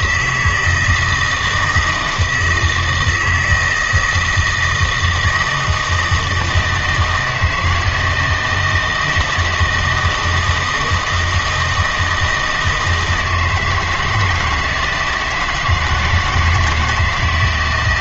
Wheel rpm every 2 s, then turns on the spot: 160, 160, 170, 160, 160, 160, 160, 160, 160.
none